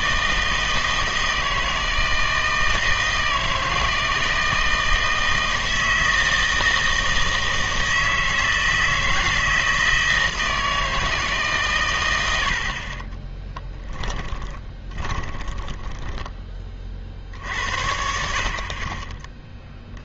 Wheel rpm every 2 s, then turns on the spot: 160, 160, 160, 160, 160, 160, 60, 20, 30, 50.
14-16